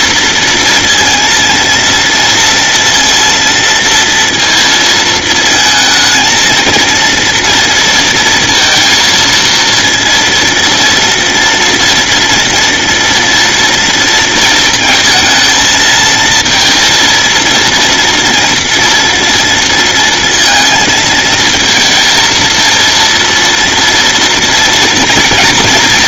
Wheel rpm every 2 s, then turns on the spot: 230, 230, 230, 230, 230, 230, 230, 220, 230, 230, 230, 230, 230.
none